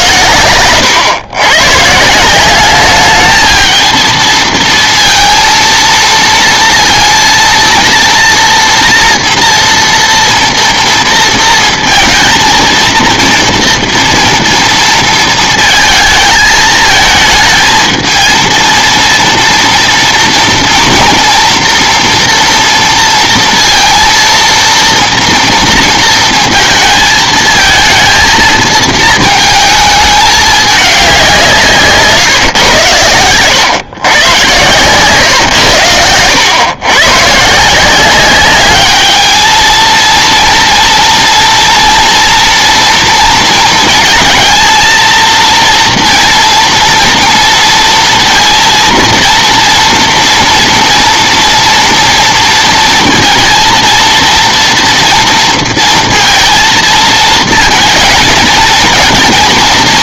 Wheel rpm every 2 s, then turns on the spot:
120, 190, 230, 230, 230, 230, 230, 230, 220, 230, 240, 240, 230, 230, 220, 210, 110, 130, 120, 200, 230, 230, 220, 230, 230, 230, 230, 230, 230, 230.
none